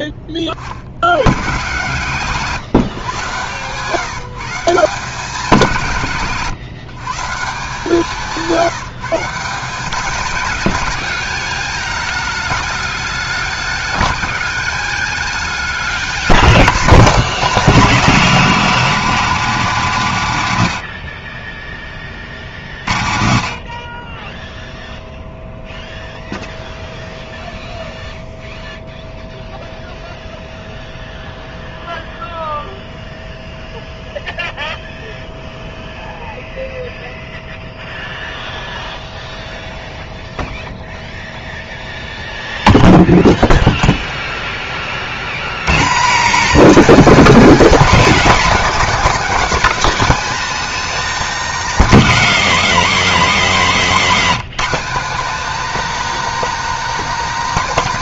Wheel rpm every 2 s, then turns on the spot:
30, 140, 160, 150, 170, 190, 210, 200, 220, 230, 120, 50, 10, 0, 0, 0, 0, 0, 0, 0, 0, 0, 10, 240, 260, 270, 230, 220, 280.
none